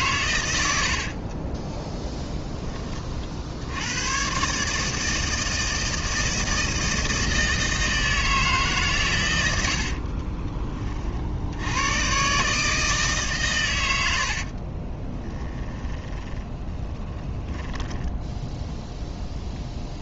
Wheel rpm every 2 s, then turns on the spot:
80, 30, 150, 160, 130, 30, 150, 40, 20, 0.
0-2 14-18